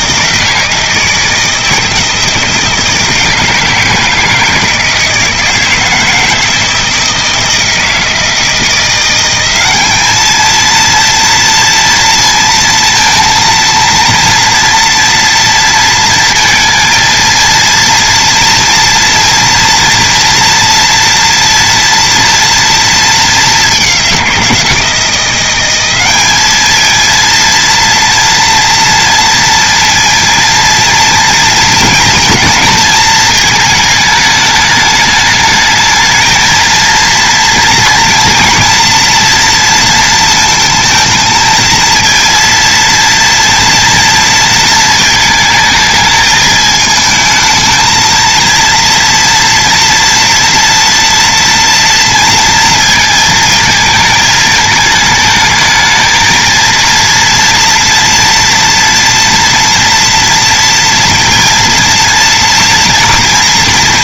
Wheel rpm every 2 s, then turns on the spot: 160, 160, 160, 160, 170, 220, 230, 230, 230, 240, 230, 230, 170, 210, 230, 230, 230, 210, 230, 230, 220, 230, 230, 220, 230, 230, 230, 220, 230, 230, 230, 230.
none